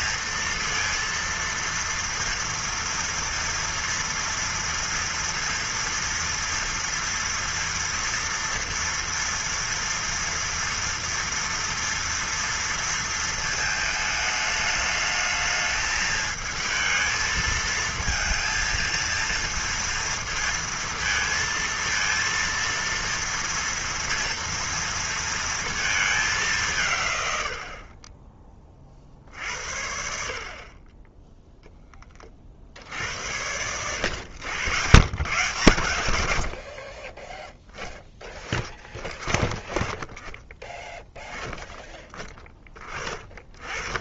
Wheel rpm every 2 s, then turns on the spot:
230, 230, 230, 240, 240, 230, 230, 210, 220, 230, 230, 230, 230, 180, 30, 40, 60, 100, 70, 30, 20, 20.
none